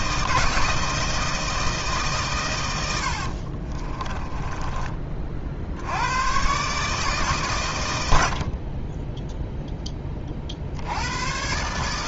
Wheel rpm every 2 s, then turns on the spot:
160, 110, 20, 140, 30, 60.
4-6